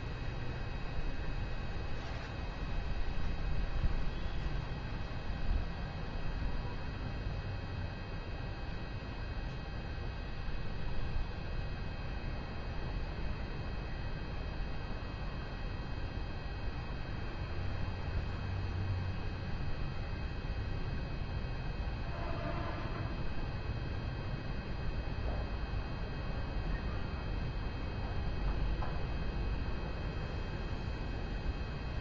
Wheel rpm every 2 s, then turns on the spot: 0, 0, 0, 0, 0, 0, 0, 0, 0, 0, 0, 0, 0, 0, 0, 0.
none